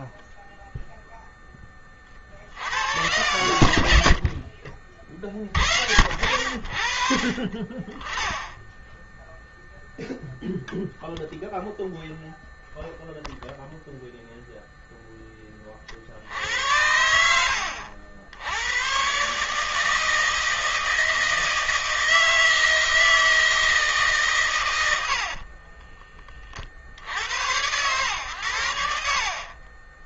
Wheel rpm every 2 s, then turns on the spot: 20, 60, 50, 60, 20, 0, 0, 0, 70, 90, 160, 160, 130, 40, 90.
4-6 8-10